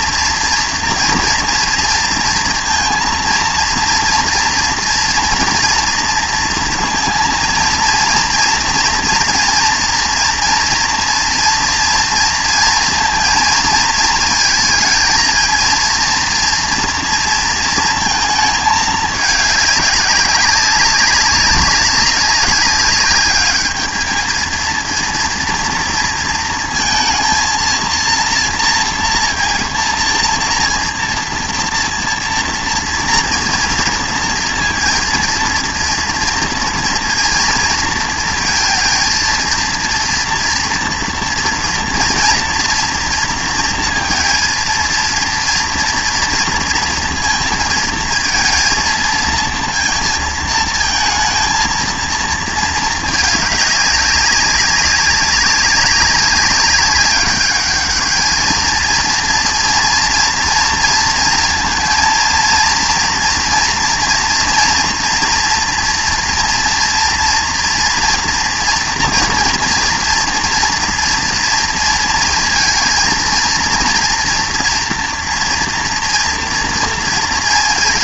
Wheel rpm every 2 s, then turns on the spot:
230, 230, 230, 230, 230, 230, 230, 230, 230, 220, 200, 190, 230, 230, 230, 230, 230, 230, 230, 230, 230, 230, 230, 230, 230, 230, 220, 200, 200, 220, 230, 230, 230, 230, 230, 230, 230, 230, 230.
none